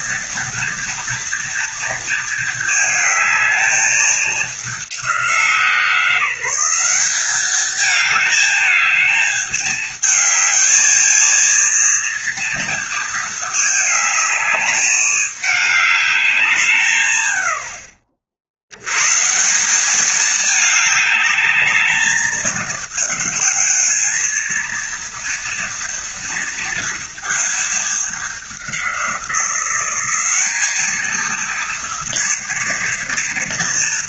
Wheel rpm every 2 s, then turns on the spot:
230, 220, 200, 180, 210, 220, 230, 210, 150, 90, 210, 220, 220, 230, 190, 220, 230.
none